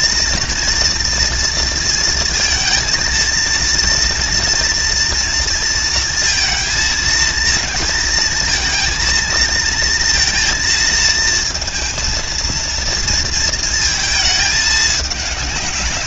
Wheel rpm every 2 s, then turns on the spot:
230, 230, 230, 230, 220, 230, 230, 210.
none